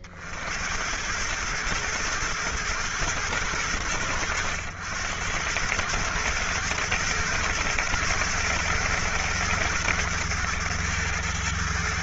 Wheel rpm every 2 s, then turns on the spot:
70, 120, 90, 120, 110, 110.
none